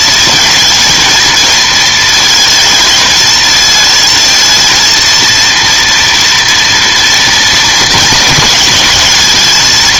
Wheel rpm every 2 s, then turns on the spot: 220, 220, 230, 230, 220.
none